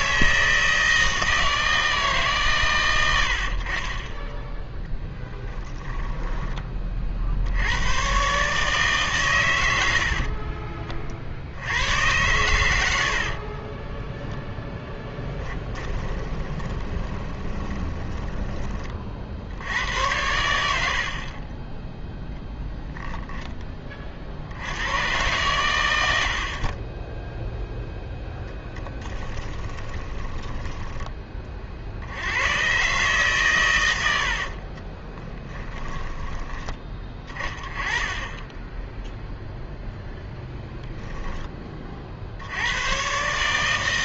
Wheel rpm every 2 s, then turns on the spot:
160, 120, 0, 20, 140, 30, 100, 10, 20, 20, 80, 0, 70, 50, 10, 20, 110, 40, 20, 20, 0, 80.
10-12 16-18 26-32 34-36